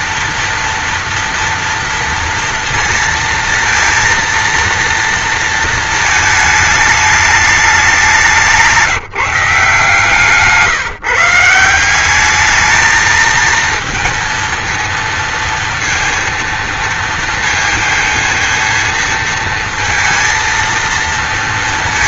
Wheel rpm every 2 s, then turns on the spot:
230, 230, 230, 210, 170, 170, 220, 230, 230, 230, 230.
none